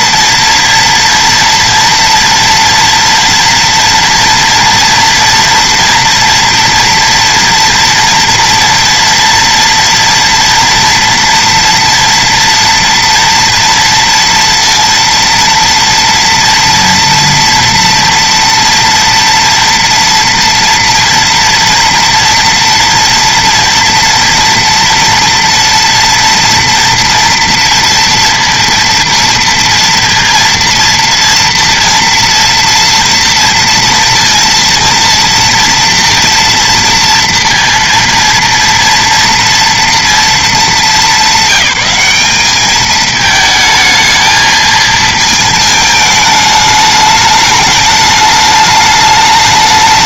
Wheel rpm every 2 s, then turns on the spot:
230, 230, 240, 240, 230, 230, 230, 230, 230, 240, 240, 230, 230, 230, 230, 230, 230, 230, 230, 230, 210, 210, 220, 210, 210.
none